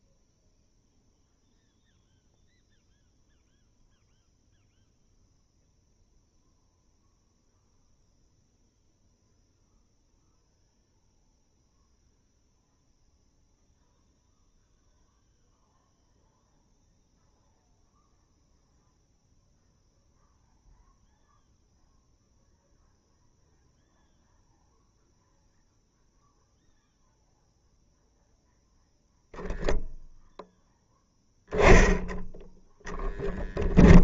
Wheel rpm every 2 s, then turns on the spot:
0, 0, 0, 0, 0, 0, 0, 0, 0, 0, 0, 0, 0, 0, 0, 0, 0.
none